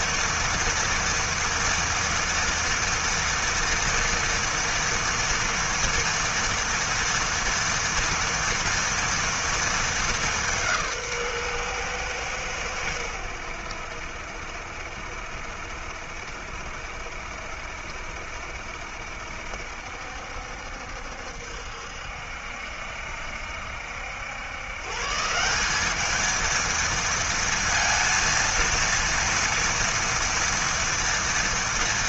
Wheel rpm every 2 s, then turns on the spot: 240, 230, 230, 230, 230, 150, 90, 70, 70, 70, 70, 70, 140, 230, 230, 230.
none